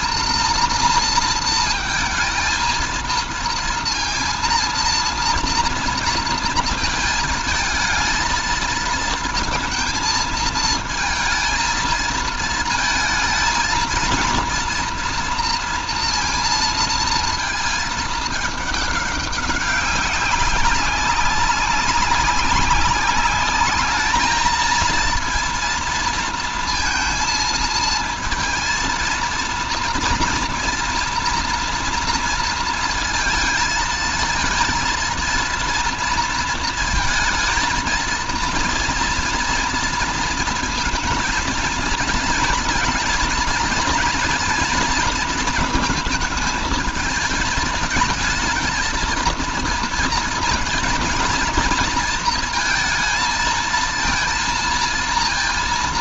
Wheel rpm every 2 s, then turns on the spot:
230, 220, 230, 230, 230, 230, 230, 230, 230, 210, 190, 200, 220, 230, 230, 230, 230, 230, 230, 230, 220, 230, 240, 220, 220, 230, 230, 230.
none